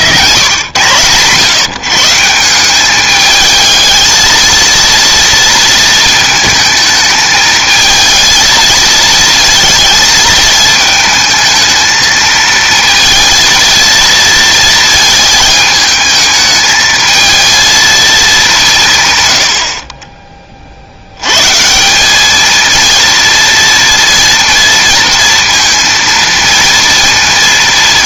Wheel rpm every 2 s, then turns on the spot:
110, 190, 230, 220, 220, 220, 230, 230, 220, 170, 60, 230, 230, 230.
none